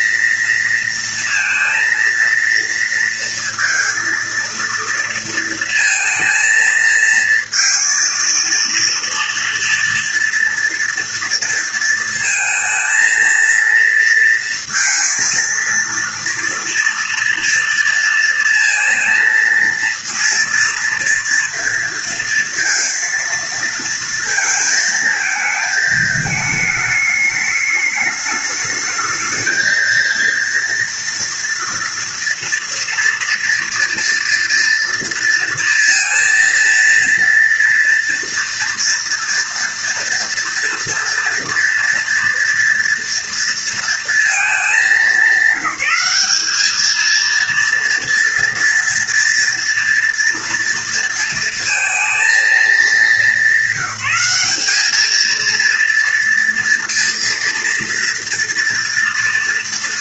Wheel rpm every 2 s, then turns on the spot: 230, 230, 230, 230, 230, 230, 230, 230, 230, 230, 230, 230, 220, 210, 210, 230, 230, 230, 230, 230, 230, 230, 210, 210, 230, 230, 220, 210, 230, 230.
none